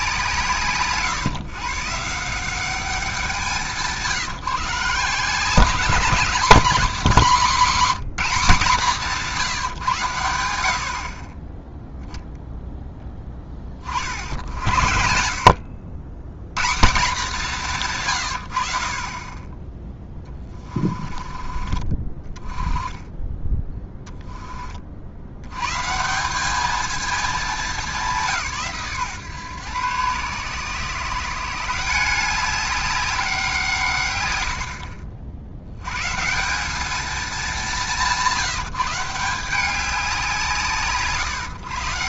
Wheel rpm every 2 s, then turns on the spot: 160, 200, 150, 200, 180, 60, 10, 70, 160, 50, 20, 20, 30, 210, 160, 140, 190, 70, 220, 160, 140.
34-36